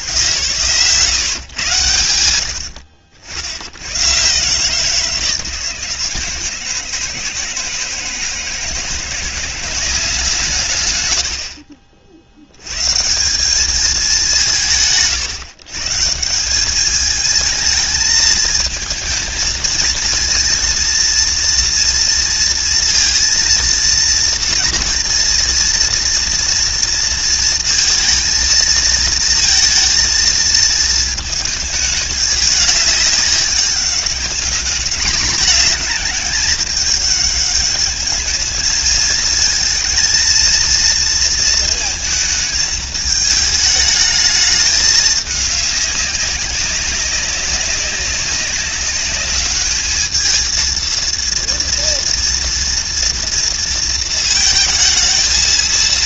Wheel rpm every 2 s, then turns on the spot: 100, 90, 150, 160, 170, 80, 120, 110, 190, 220, 230, 230, 230, 230, 230, 220, 200, 200, 210, 220, 230, 220, 210, 190, 200, 230, 230, 220.
2-4